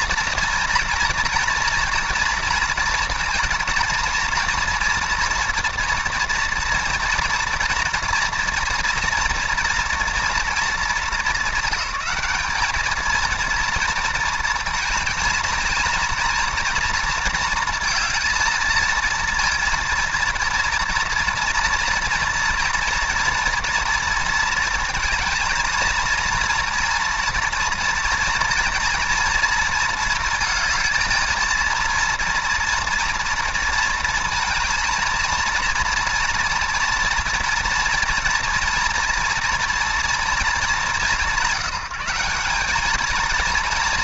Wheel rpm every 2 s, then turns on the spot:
240, 230, 230, 230, 240, 210, 210, 230, 230, 230, 230, 230, 230, 230, 230, 220, 230, 220, 230, 230, 180, 210.
none